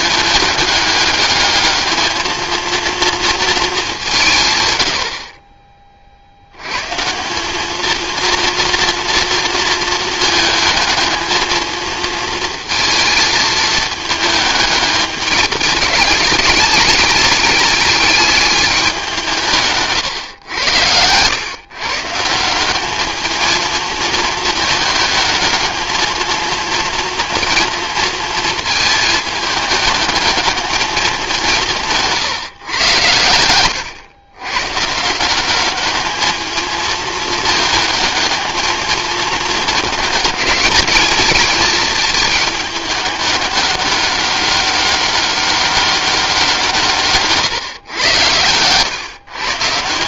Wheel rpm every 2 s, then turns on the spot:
210, 230, 130, 110, 230, 220, 230, 210, 210, 210, 110, 190, 220, 230, 220, 210, 130, 130, 220, 220, 210, 210, 200, 170, 120.
none